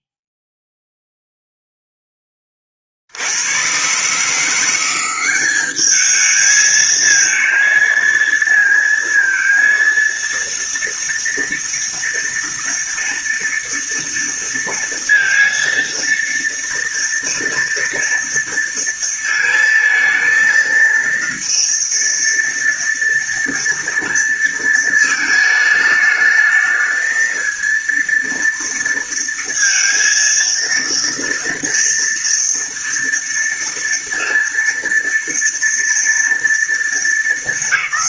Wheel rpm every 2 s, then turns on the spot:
0, 50, 180, 220, 230, 230, 230, 230, 230, 230, 230, 230, 230, 220, 230, 230, 230, 230, 230.
none